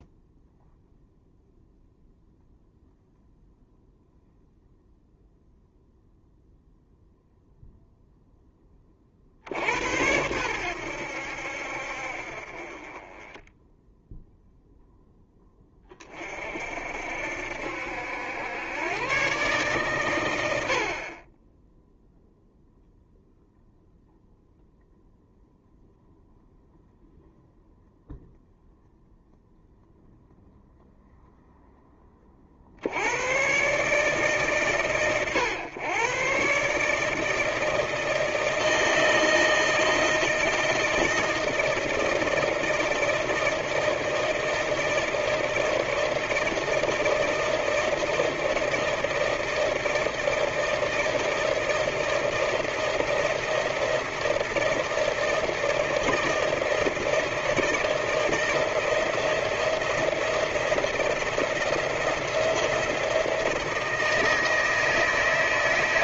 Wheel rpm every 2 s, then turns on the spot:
0, 0, 0, 0, 20, 90, 30, 0, 60, 110, 60, 0, 0, 0, 0, 0, 70, 130, 150, 160, 160, 160, 160, 160, 160, 160, 160, 160, 160, 170, 170, 170, 160.
none